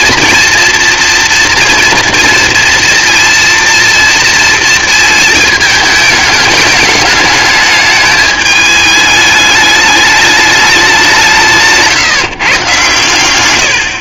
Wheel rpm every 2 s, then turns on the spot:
230, 230, 230, 210, 210, 200, 130.
none